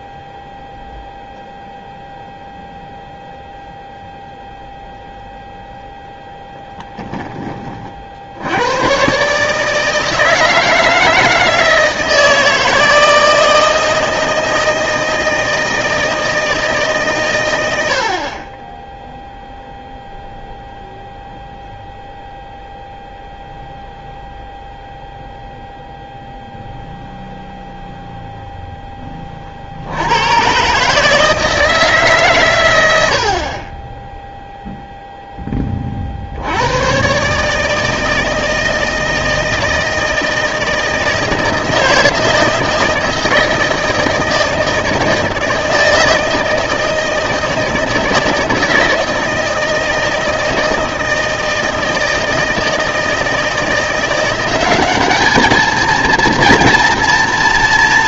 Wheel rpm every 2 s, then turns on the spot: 0, 0, 0, 10, 100, 160, 160, 160, 150, 20, 0, 0, 0, 0, 0, 130, 110, 0, 100, 160, 160, 160, 160, 160, 160, 160, 160, 190, 240.
6-8